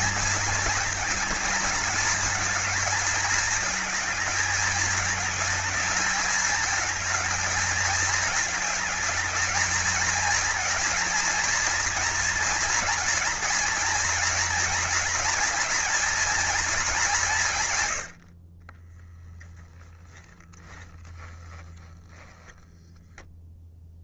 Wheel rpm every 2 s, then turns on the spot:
230, 220, 210, 220, 220, 230, 230, 230, 210, 10, 10, 0.
none